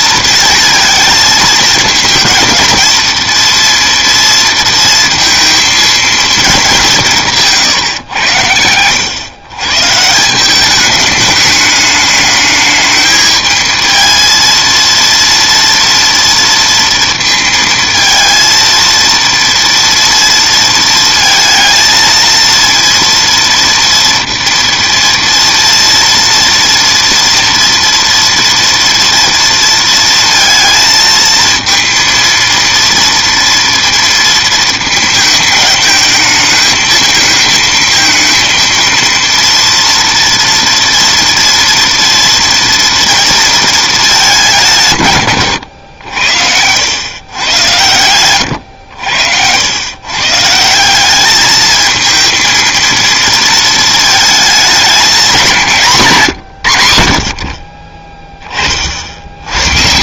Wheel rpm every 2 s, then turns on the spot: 230, 230, 230, 190, 90, 200, 210, 230, 230, 230, 230, 230, 230, 230, 230, 230, 230, 220, 220, 230, 230, 230, 170, 110, 90, 170, 230, 210, 80, 40.
none